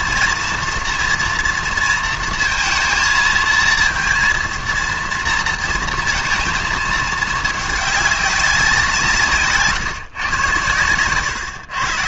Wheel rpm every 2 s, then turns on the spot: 230, 230, 230, 230, 180, 110.
10-12